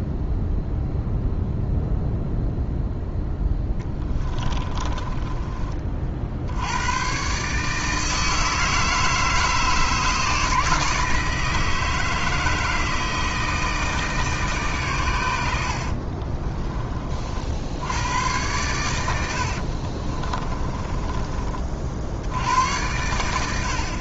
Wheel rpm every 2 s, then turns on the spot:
0, 0, 20, 110, 160, 160, 160, 130, 30, 100, 20, 100.
4-6 20-22